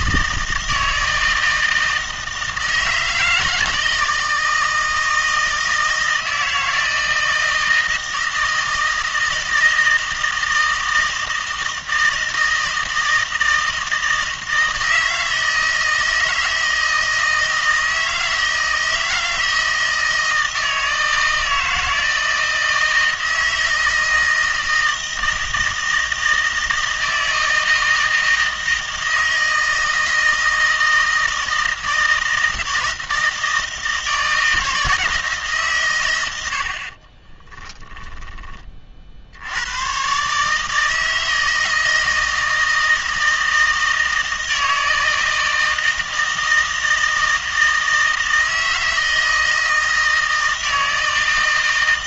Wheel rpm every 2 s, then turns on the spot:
160, 160, 160, 160, 160, 160, 160, 160, 160, 160, 160, 160, 160, 160, 160, 160, 160, 160, 50, 40, 150, 160, 160, 160, 160, 160.
none